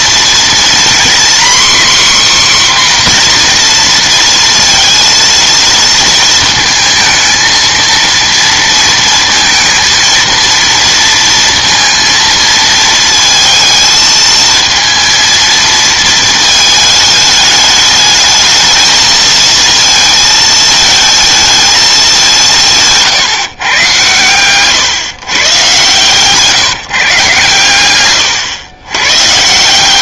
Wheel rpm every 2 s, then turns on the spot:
240, 260, 230, 220, 230, 230, 220, 220, 210, 220, 220, 160, 130, 160, 120.
none